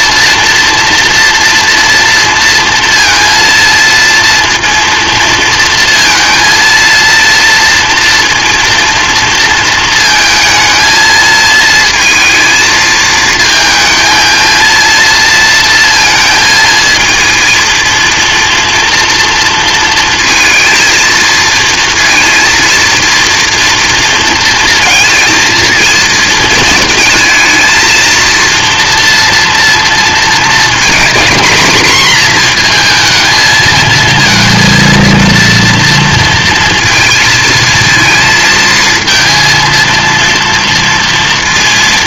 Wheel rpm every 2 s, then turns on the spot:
240, 230, 230, 230, 230, 220, 220, 230, 230, 230, 230, 230, 230, 220, 230, 230, 240, 230, 230, 220, 230.
none